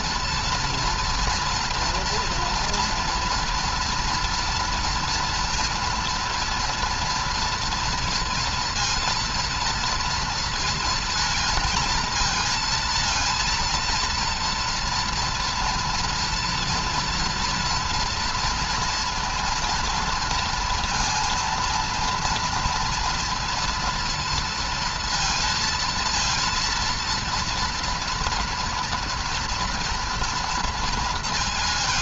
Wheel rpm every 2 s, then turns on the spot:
230, 230, 230, 240, 230, 230, 230, 230, 230, 230, 230, 230, 230, 230, 230, 230.
none